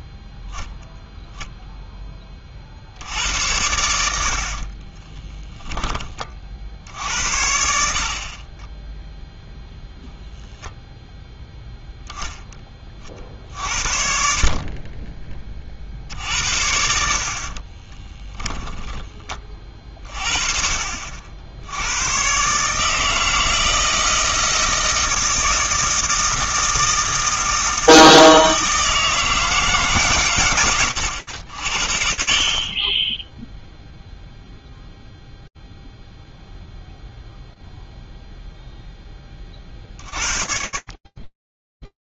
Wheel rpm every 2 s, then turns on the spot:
0, 50, 50, 50, 20, 0, 10, 40, 70, 10, 40, 140, 160, 160, 160, 120, 60, 0, 0, 0, 40.
4-6 18-20